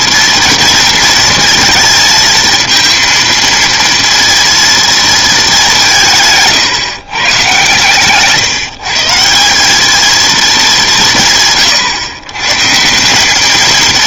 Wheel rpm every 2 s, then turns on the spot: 230, 230, 230, 150, 160, 190, 160.
none